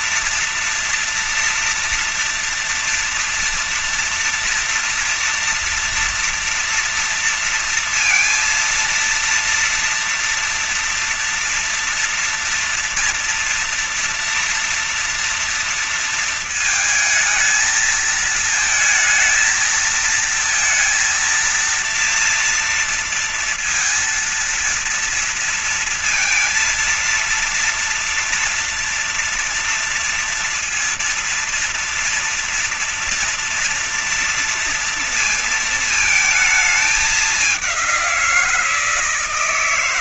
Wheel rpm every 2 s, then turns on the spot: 240, 240, 230, 230, 230, 230, 230, 230, 220, 220, 230, 230, 230, 230, 230, 230, 240, 230, 210, 170.
none